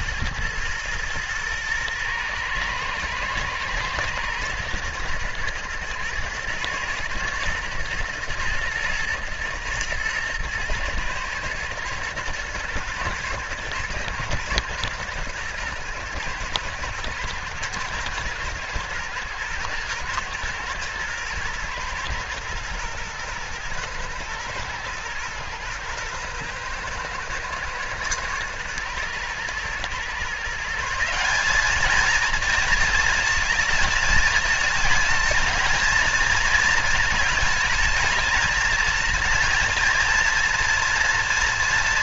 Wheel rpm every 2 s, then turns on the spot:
110, 110, 110, 120, 120, 110, 110, 120, 110, 110, 110, 120, 110, 120, 110, 160, 220, 220, 220, 220, 230.
none